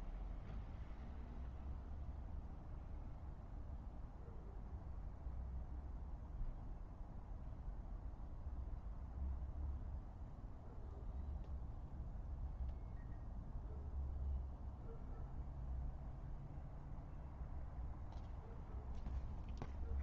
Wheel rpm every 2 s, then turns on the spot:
0, 0, 0, 0, 0, 0, 0, 0, 0, 0.
none